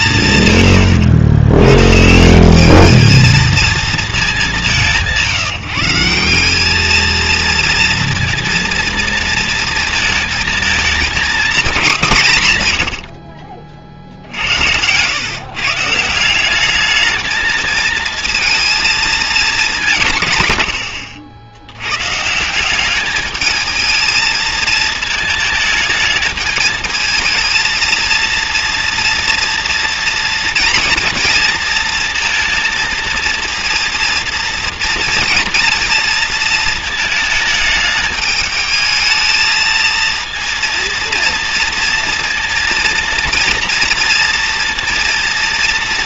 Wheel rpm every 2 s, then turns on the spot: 110, 220, 170, 230, 230, 210, 40, 140, 220, 220, 80, 210, 220, 220, 240, 230, 230, 230, 220, 220, 230, 230, 230.
none